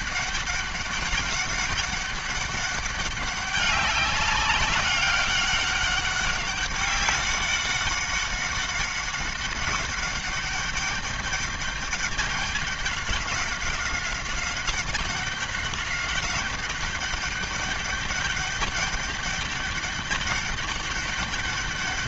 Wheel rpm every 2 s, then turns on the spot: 200, 200, 190, 200, 200, 200, 200, 190, 200, 200, 200.
none